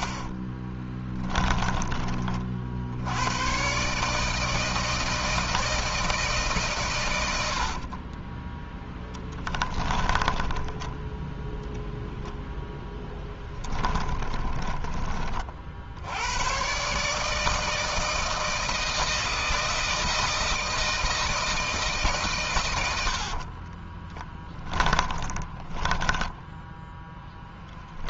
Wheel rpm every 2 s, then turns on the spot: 20, 70, 160, 120, 10, 10, 0, 30, 140, 160, 160, 90, 20, 10.
0-2 6-10 22-26